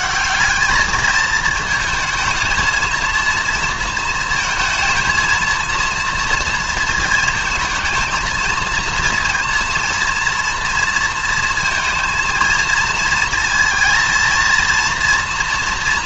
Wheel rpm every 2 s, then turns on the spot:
200, 220, 230, 230, 230, 230, 230, 230.
none